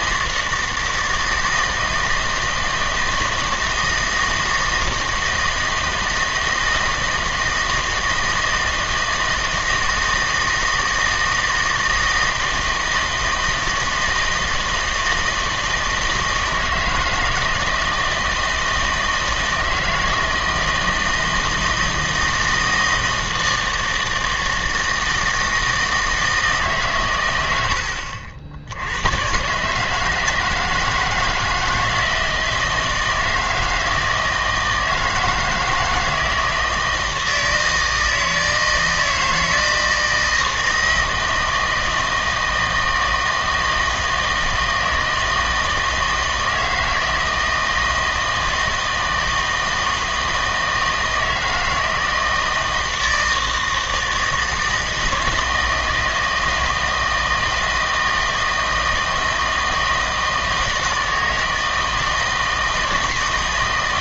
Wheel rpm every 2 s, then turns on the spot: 160, 160, 160, 160, 160, 160, 160, 160, 160, 160, 160, 160, 160, 140, 90, 160, 160, 160, 160, 160, 160, 160, 160, 160, 160, 160, 160, 160, 160, 160, 160, 160.
none